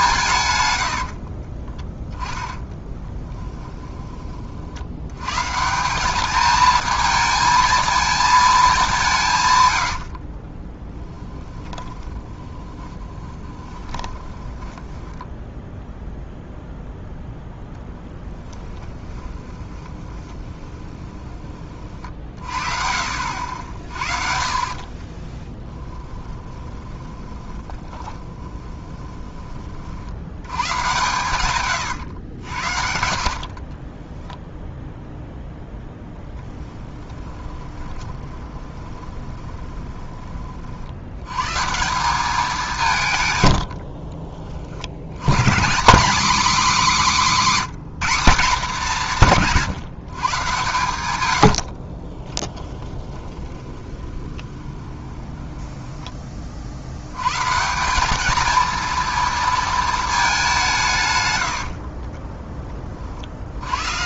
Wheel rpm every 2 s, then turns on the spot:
120, 10, 40, 220, 210, 20, 20, 20, 0, 10, 20, 50, 40, 20, 20, 110, 80, 0, 10, 20, 40, 190, 60, 260, 200, 120, 10, 20, 40, 220, 180, 20.
2-4 10-16 18-22 24-30 36-40 52-56